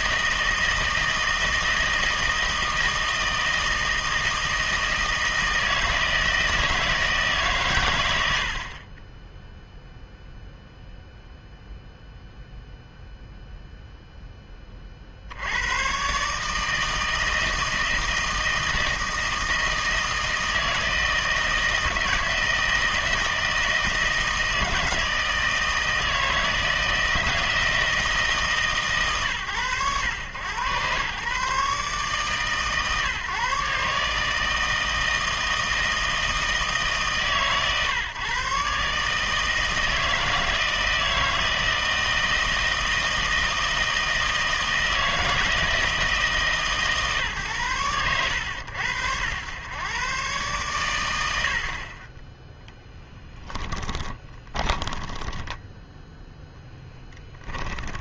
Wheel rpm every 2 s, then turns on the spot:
160, 160, 160, 160, 50, 0, 0, 30, 150, 160, 160, 160, 160, 160, 150, 110, 140, 160, 150, 140, 160, 160, 160, 150, 80, 120, 10, 10, 10.
54-58